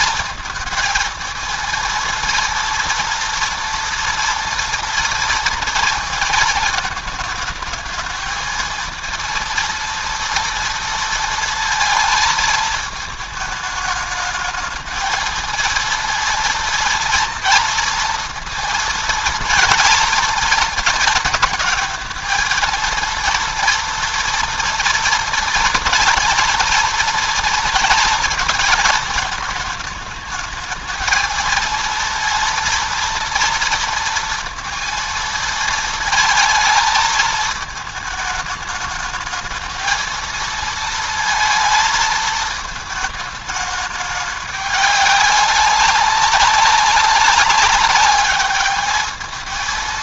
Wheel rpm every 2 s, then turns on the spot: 230, 230, 230, 220, 230, 230, 220, 220, 230, 230, 230, 230, 230, 230, 220, 220, 230, 230, 220, 210, 230, 220, 200, 200, 210.
none